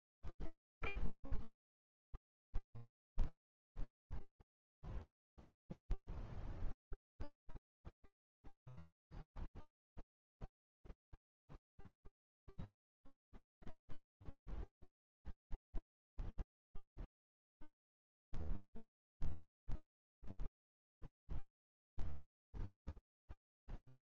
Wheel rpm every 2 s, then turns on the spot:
0, 0, 0, 0, 0, 0, 0, 0, 0, 0, 0, 0.
none